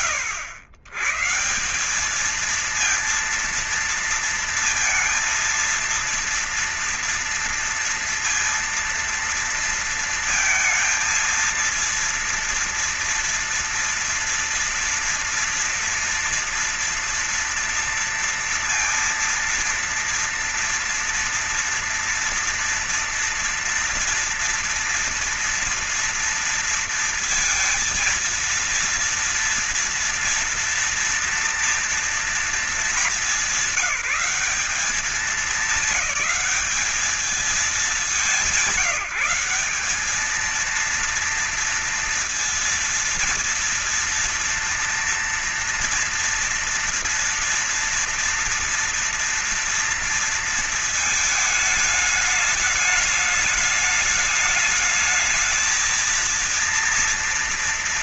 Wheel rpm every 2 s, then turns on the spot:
100, 230, 230, 230, 230, 230, 230, 230, 230, 230, 230, 230, 230, 230, 230, 230, 220, 200, 210, 190, 230, 240, 240, 230, 240, 220, 210, 220, 230.
none